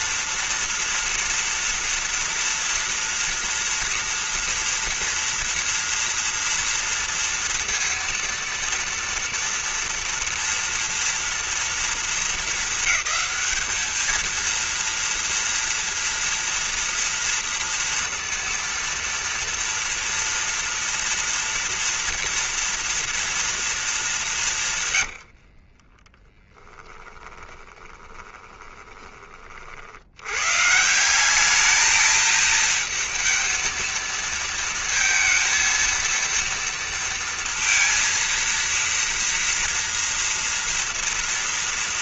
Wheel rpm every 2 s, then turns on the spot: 230, 240, 230, 230, 230, 230, 220, 220, 230, 230, 230, 230, 200, 20, 20, 90, 220, 230, 230, 230, 230.
26-30